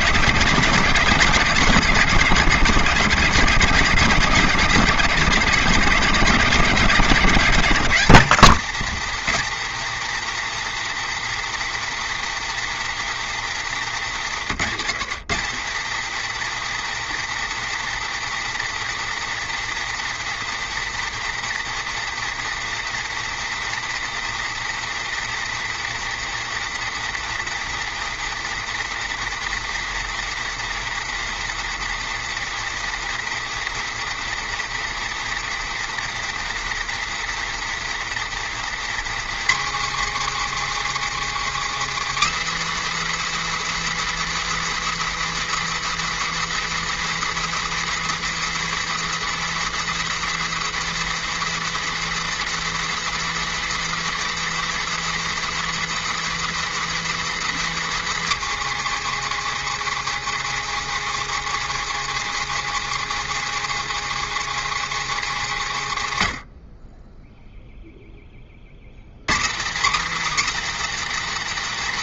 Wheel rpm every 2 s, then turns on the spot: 150, 140, 160, 160, 210, 240, 240, 200, 240, 240, 240, 240, 240, 240, 240, 240, 240, 240, 240, 240, 290, 330, 350, 350, 350, 350, 350, 350, 350, 310, 290, 290, 290, 70, 70, 300.
none